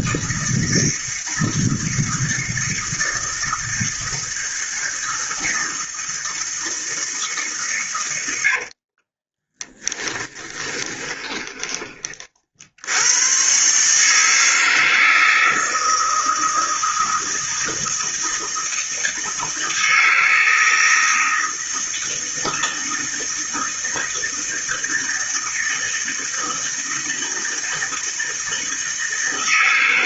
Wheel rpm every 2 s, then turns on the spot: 160, 160, 160, 160, 40, 20, 80, 160, 160, 160, 160, 160, 160, 160, 160.
8-12